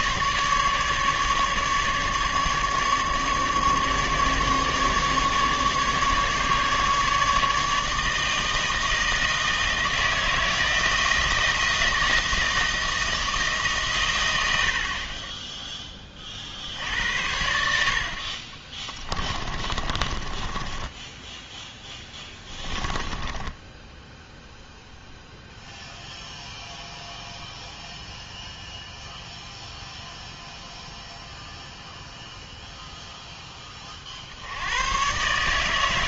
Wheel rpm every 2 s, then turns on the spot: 150, 150, 150, 150, 160, 160, 160, 50, 60, 20, 10, 20, 0, 0, 0, 0, 0, 100.
18-24